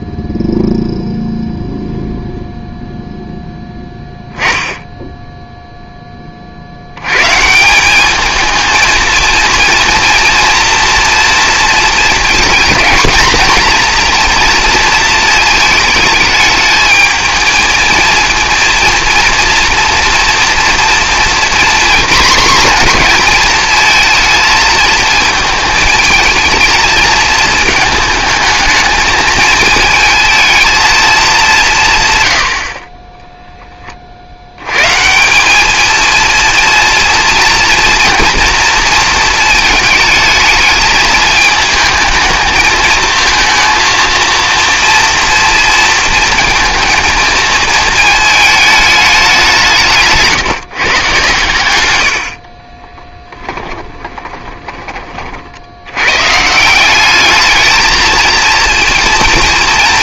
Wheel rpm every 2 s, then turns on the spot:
0, 0, 0, 70, 220, 230, 220, 230, 220, 230, 230, 240, 230, 220, 220, 230, 70, 110, 230, 230, 220, 220, 230, 230, 220, 150, 30, 30, 160, 230.
52-56